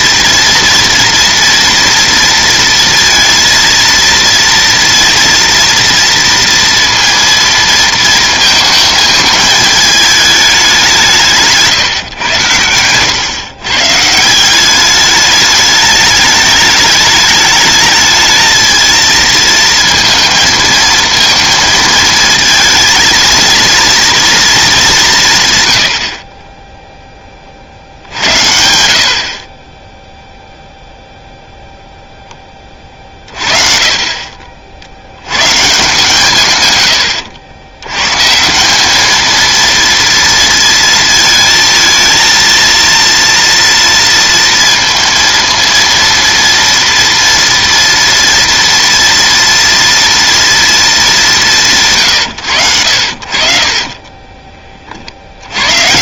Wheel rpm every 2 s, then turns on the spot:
240, 230, 230, 230, 220, 200, 100, 190, 210, 220, 230, 230, 220, 20, 80, 0, 20, 50, 130, 180, 230, 230, 230, 230, 230, 230, 90, 30.
none